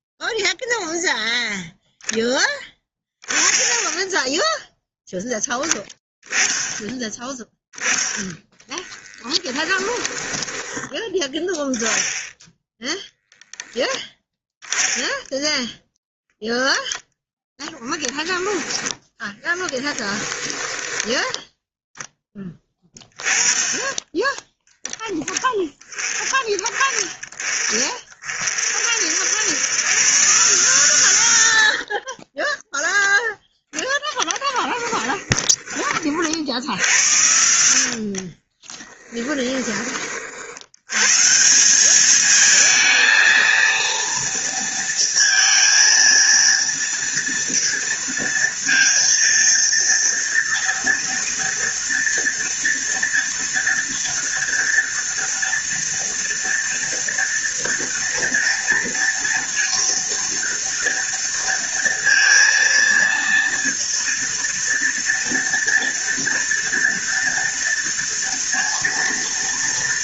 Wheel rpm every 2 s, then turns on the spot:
0, 0, 0, 10, 10, 10, 0, 10, 0, 10, 10, 10, 10, 20, 40, 140, 20, 10, 50, 30, 70, 220, 230, 230, 230, 230, 240, 230, 230, 230, 230, 230, 230, 230, 230.
8-12 20-22 32-34 38-40